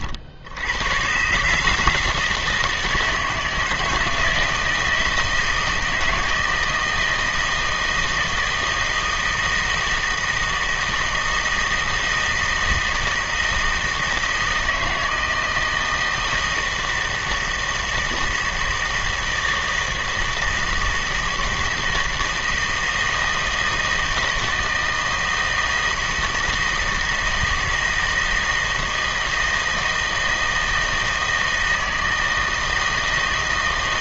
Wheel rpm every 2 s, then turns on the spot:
100, 160, 160, 160, 160, 160, 160, 160, 160, 160, 160, 160, 160, 160, 160, 160, 160.
none